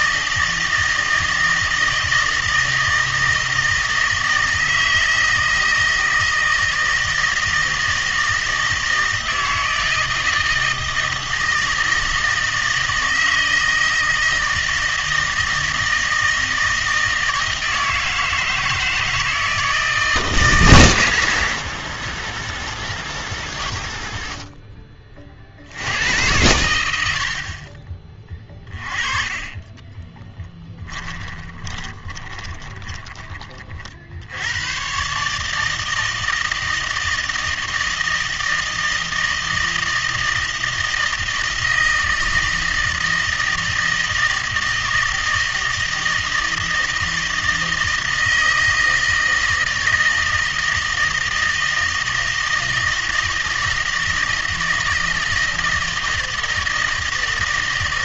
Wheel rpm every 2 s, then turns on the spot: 160, 160, 160, 160, 160, 160, 160, 160, 160, 160, 130, 70, 30, 90, 30, 10, 20, 110, 160, 160, 160, 160, 160, 160, 160, 160, 160, 160, 160.
28-34